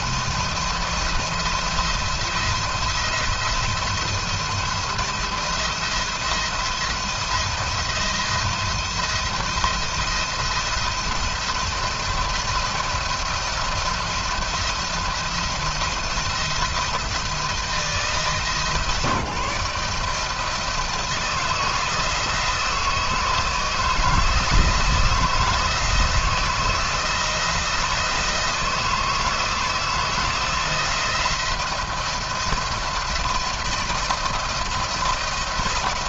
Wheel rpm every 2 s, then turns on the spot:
160, 170, 170, 170, 170, 170, 170, 170, 170, 150, 160, 160, 160, 160, 160, 170, 170, 170.
none